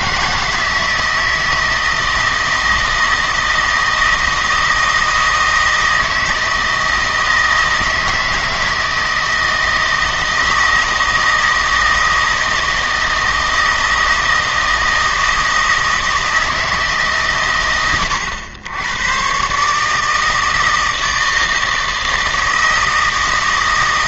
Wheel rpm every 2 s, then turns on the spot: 160, 160, 160, 160, 160, 160, 160, 160, 150, 100, 160, 160.
none